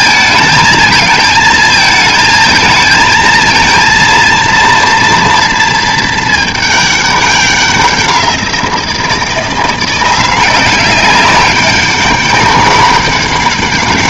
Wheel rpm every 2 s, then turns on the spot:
220, 220, 230, 210, 170, 190, 200.
none